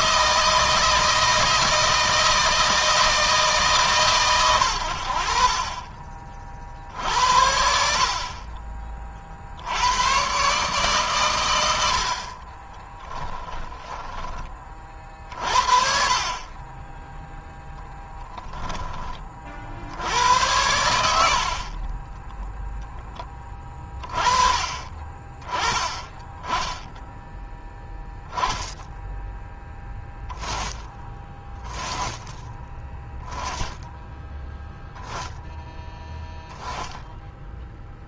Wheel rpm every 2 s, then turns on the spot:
160, 160, 110, 50, 40, 120, 50, 30, 40, 10, 100, 10, 30, 10, 0, 10, 10, 0, 0.
12-14 20-24